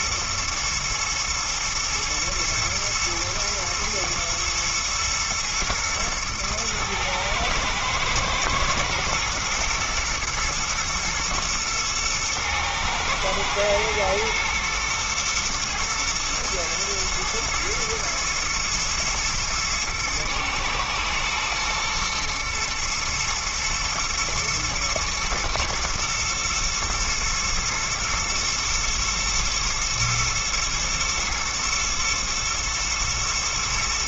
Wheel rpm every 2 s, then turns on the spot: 120, 110, 110, 110, 110, 110, 110, 120, 110, 110, 110, 110, 110, 120, 110, 110, 110.
none